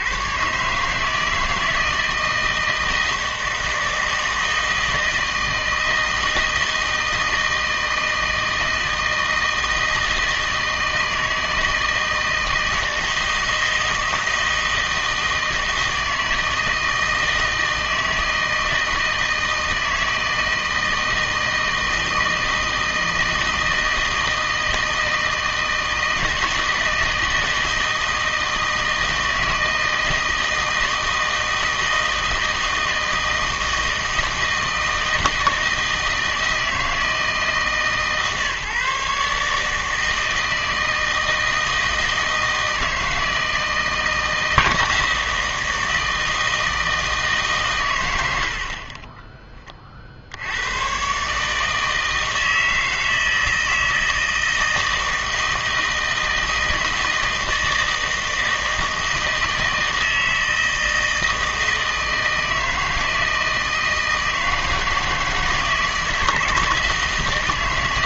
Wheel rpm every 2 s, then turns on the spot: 140, 160, 160, 160, 160, 160, 160, 160, 160, 160, 160, 160, 160, 160, 160, 160, 160, 160, 160, 150, 160, 160, 160, 160, 50, 100, 160, 160, 160, 160, 160, 160, 160, 160.
none